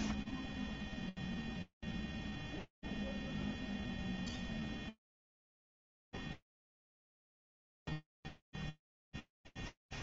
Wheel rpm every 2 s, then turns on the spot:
10, 10, 20, 10, 10.
0-10